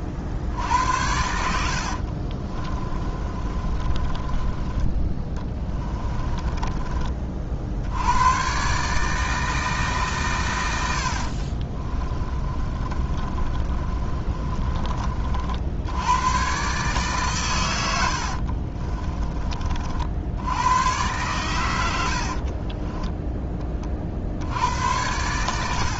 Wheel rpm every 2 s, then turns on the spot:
80, 30, 20, 30, 140, 80, 30, 40, 140, 40, 110, 20, 90.
2-4 12-14 18-20 22-24